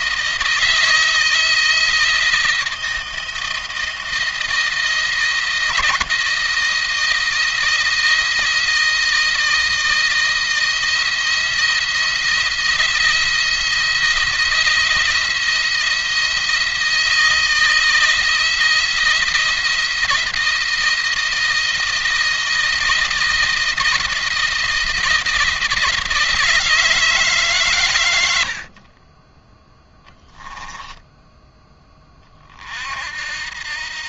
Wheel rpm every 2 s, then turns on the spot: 160, 160, 160, 160, 160, 160, 170, 170, 170, 160, 170, 170, 160, 160, 60, 10, 40.
30-32